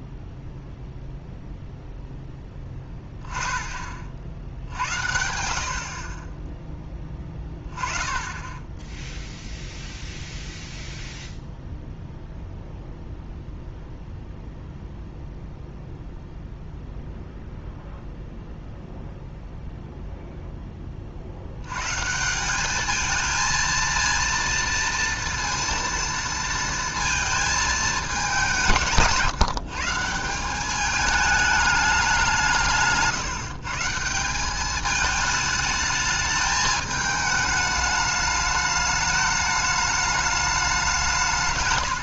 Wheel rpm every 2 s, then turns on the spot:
0, 10, 70, 10, 10, 0, 0, 0, 0, 0, 20, 200, 230, 230, 180, 190, 170, 200, 210, 210, 200.
none